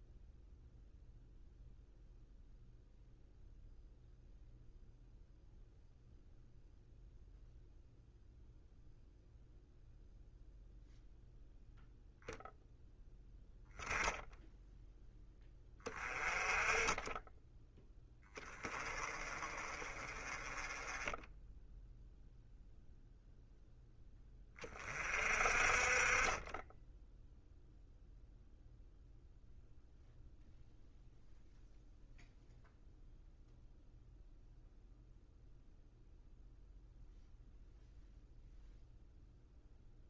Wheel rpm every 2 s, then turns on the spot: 0, 0, 0, 0, 0, 0, 0, 0, 20, 20, 20, 0, 30, 10, 0, 0, 0, 0, 0, 0.
none